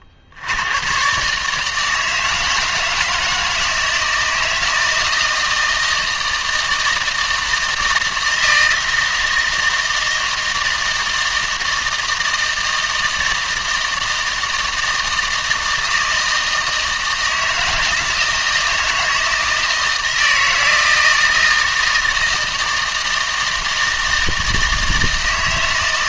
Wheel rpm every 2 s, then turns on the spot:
100, 160, 160, 160, 160, 160, 160, 160, 160, 160, 160, 160, 160.
none